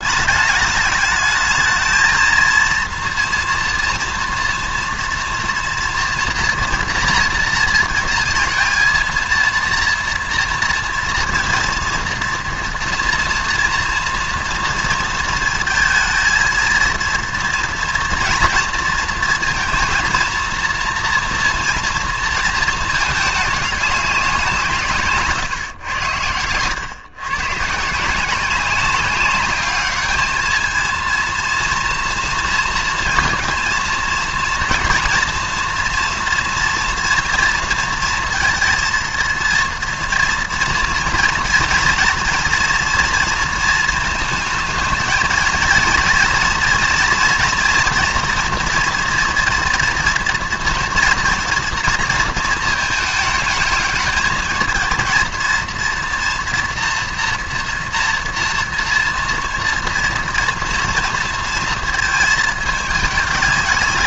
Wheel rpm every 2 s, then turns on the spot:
210, 230, 230, 230, 230, 230, 230, 230, 230, 230, 230, 220, 160, 100, 190, 220, 230, 230, 230, 230, 230, 230, 220, 230, 230, 240, 220, 220, 230, 230, 230, 210.
none